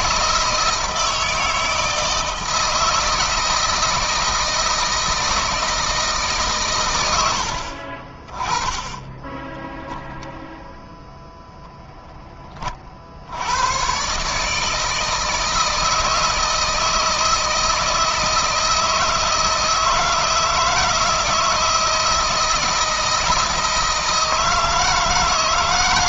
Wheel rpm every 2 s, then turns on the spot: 160, 160, 160, 140, 20, 10, 30, 150, 160, 160, 160, 160, 160.
none